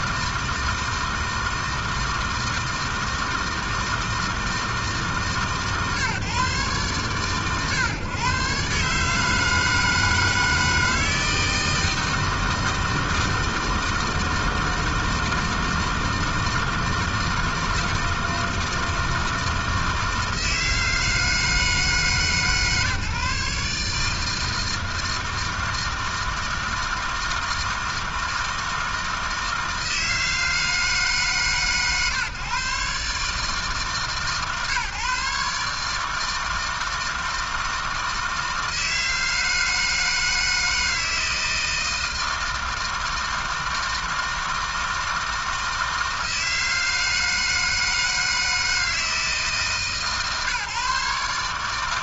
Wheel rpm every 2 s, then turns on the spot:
160, 160, 160, 120, 140, 160, 160, 160, 160, 160, 160, 150, 160, 160, 160, 160, 140, 140, 160, 160, 160, 160, 160, 160, 160, 140.
none